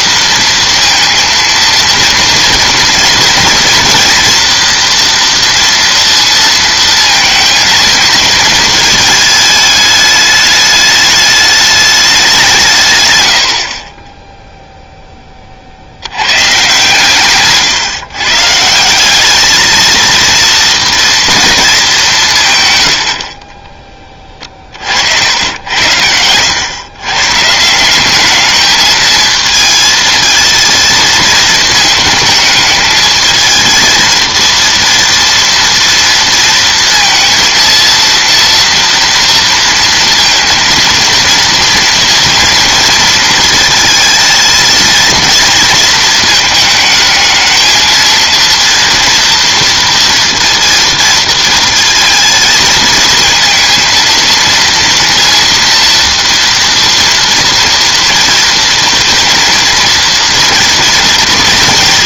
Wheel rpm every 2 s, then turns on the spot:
230, 230, 230, 230, 230, 210, 160, 0, 130, 150, 230, 120, 50, 110, 210, 220, 210, 230, 230, 230, 230, 230, 230, 220, 230, 230, 220, 230, 230, 230, 230.
22-24